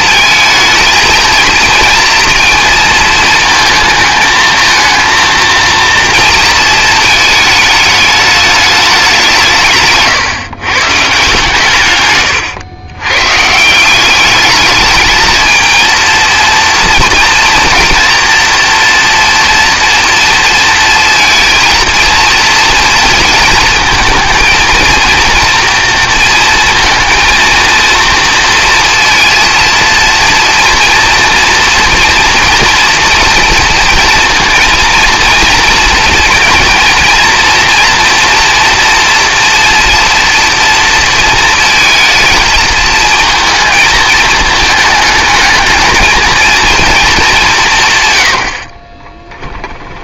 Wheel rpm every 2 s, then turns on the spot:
220, 230, 220, 230, 210, 140, 100, 210, 230, 240, 230, 230, 230, 230, 230, 230, 230, 230, 220, 230, 230, 220, 220, 230, 60.
none